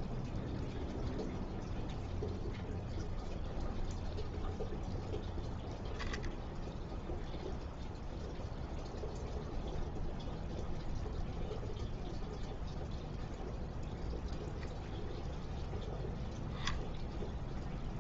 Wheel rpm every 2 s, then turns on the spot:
0, 0, 0, 0, 0, 0, 0, 0, 0.
none